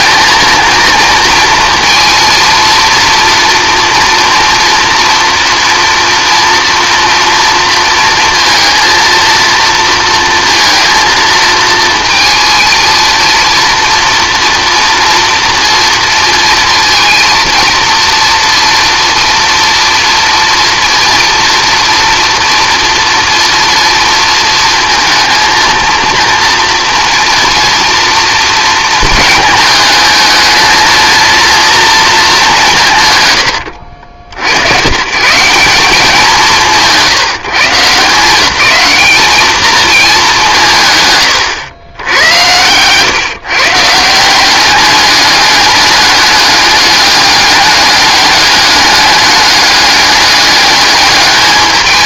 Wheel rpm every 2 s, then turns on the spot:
230, 230, 230, 230, 230, 220, 230, 240, 230, 230, 230, 230, 220, 240, 220, 220, 170, 110, 170, 200, 150, 110, 200, 210, 200, 210.
none